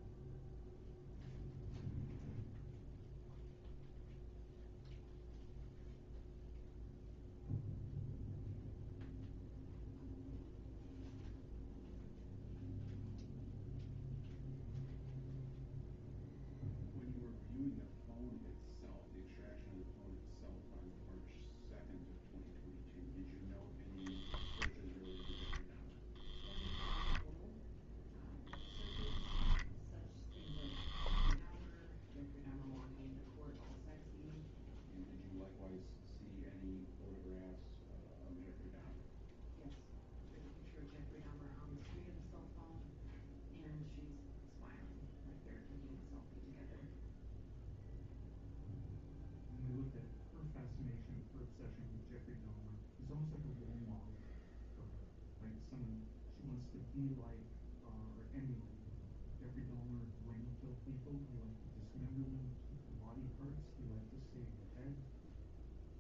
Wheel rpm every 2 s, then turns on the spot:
0, 0, 0, 0, 0, 0, 0, 0, 0, 0, 0, 0, 10, 0, 10, 10, 0, 0, 0, 0, 0, 0, 0, 0, 0, 0, 0, 0, 0, 0, 0, 0, 0.
30-32